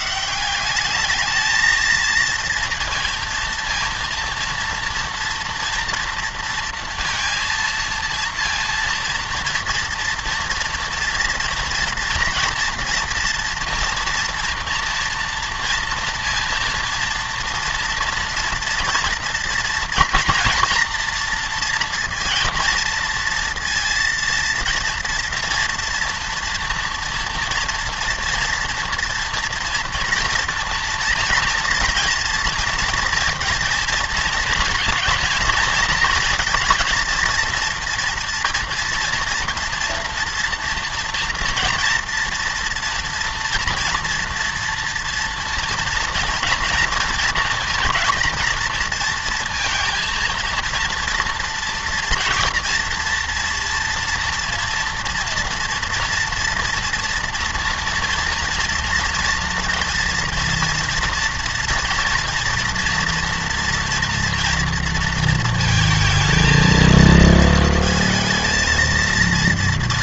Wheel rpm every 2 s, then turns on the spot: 190, 230, 230, 230, 230, 240, 240, 230, 230, 230, 230, 230, 230, 230, 230, 230, 240, 230, 230, 230, 230, 240, 230, 230, 230, 230, 230, 230, 240, 230, 230, 240, 230, 230, 230.
none